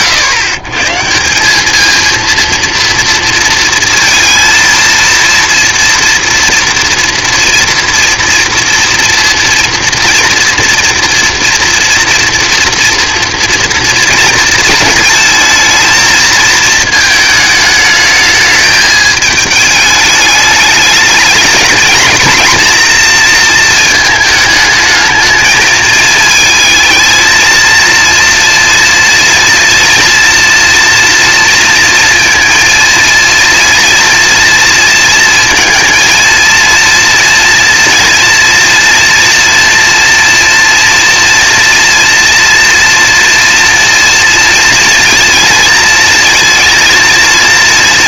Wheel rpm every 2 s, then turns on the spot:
110, 230, 230, 230, 240, 230, 230, 230, 220, 210, 210, 240, 220, 220, 230, 230, 230, 230, 230, 230, 230, 230, 230, 230.
none